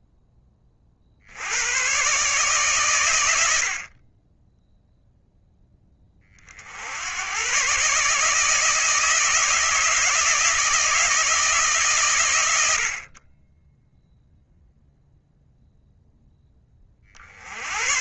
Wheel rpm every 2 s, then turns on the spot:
40, 110, 0, 80, 160, 160, 50, 0, 60.
none